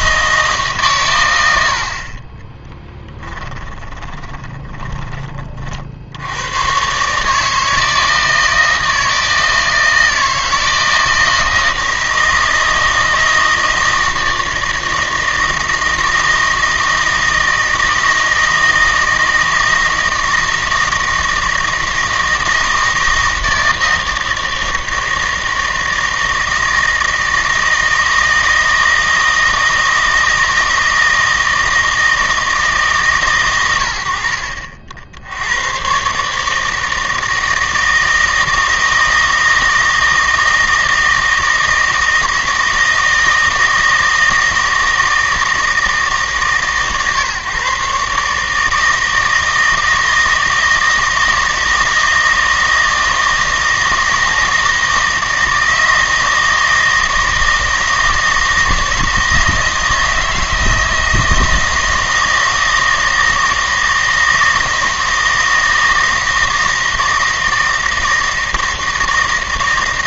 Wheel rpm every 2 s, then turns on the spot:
140, 10, 20, 120, 160, 160, 160, 160, 160, 160, 160, 160, 160, 160, 160, 160, 150, 60, 160, 160, 160, 160, 160, 140, 160, 160, 160, 160, 160, 160, 160, 160, 160, 160, 160.
2-6